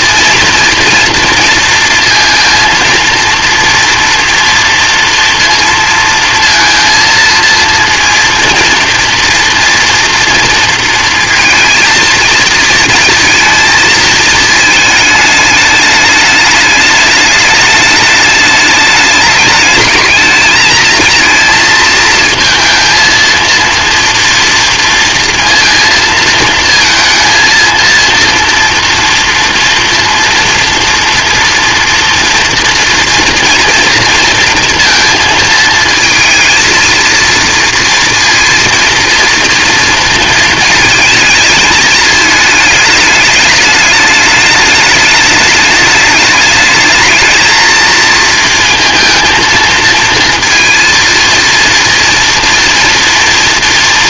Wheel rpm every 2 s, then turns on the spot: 230, 230, 230, 230, 230, 230, 230, 220, 210, 210, 220, 230, 230, 230, 230, 230, 230, 230, 220, 230, 230, 210, 210, 210, 220, 230, 240.
none